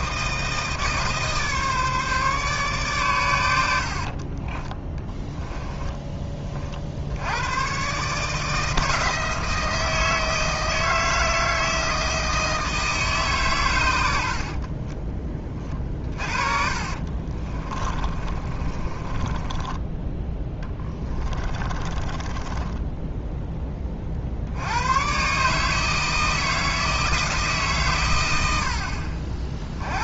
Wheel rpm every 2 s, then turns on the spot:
160, 140, 20, 40, 160, 160, 160, 40, 40, 30, 20, 10, 90, 160, 80.
4-6 14-24